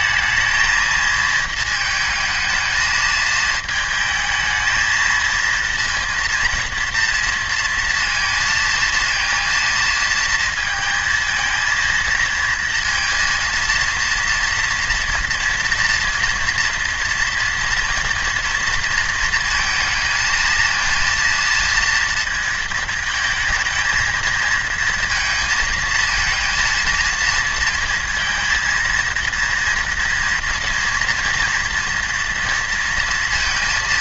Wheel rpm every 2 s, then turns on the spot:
230, 220, 220, 230, 230, 230, 230, 230, 230, 230, 230, 220, 220, 230, 230, 230, 230.
none